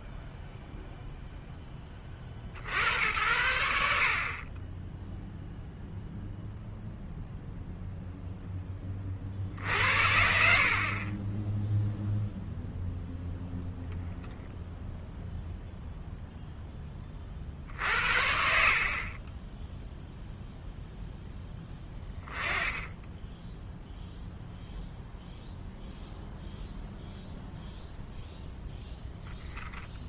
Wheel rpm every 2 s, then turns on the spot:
0, 80, 10, 0, 20, 50, 0, 0, 10, 50, 0, 10, 0, 0, 0.
none